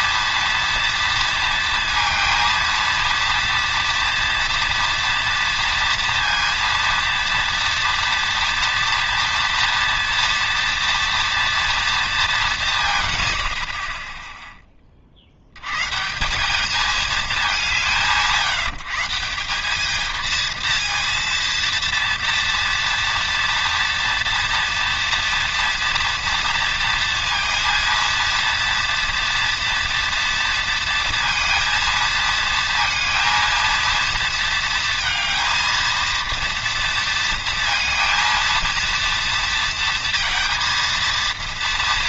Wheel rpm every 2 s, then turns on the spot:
230, 230, 230, 230, 230, 240, 190, 10, 200, 160, 230, 240, 230, 230, 230, 230, 230, 230, 230, 230, 230.
none